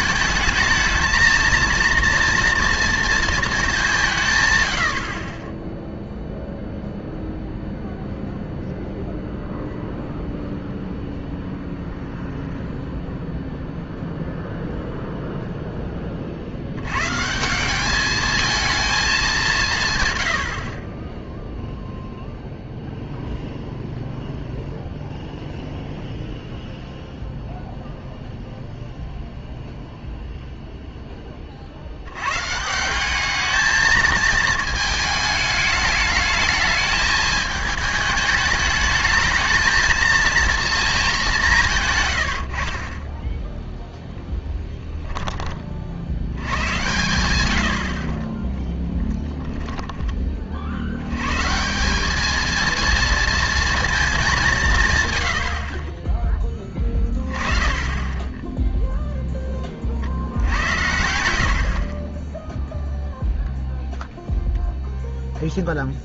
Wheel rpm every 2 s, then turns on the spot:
210, 230, 110, 0, 0, 0, 0, 0, 80, 230, 70, 0, 0, 0, 0, 0, 150, 220, 220, 210, 230, 60, 10, 100, 10, 50, 220, 170, 10, 10, 90, 0, 0.
44-46 48-50